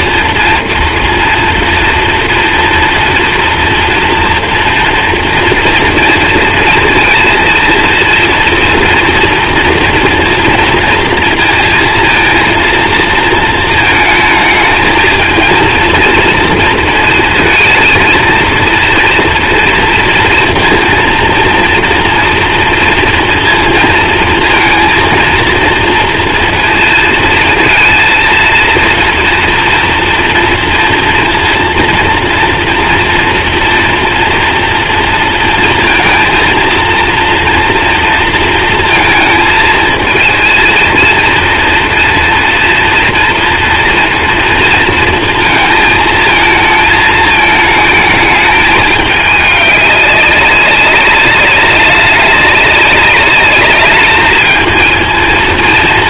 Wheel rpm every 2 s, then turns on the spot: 230, 240, 240, 230, 230, 230, 230, 220, 230, 230, 230, 230, 230, 230, 230, 230, 240, 230, 230, 230, 220, 230, 230, 220, 220, 200, 200, 220.
none